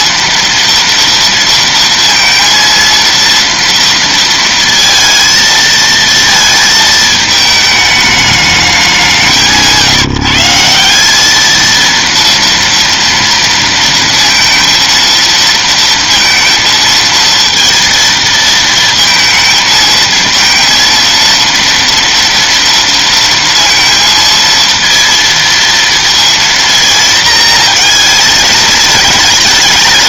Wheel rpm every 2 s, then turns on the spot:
230, 230, 230, 220, 210, 170, 230, 230, 230, 220, 230, 230, 230, 230, 220.
none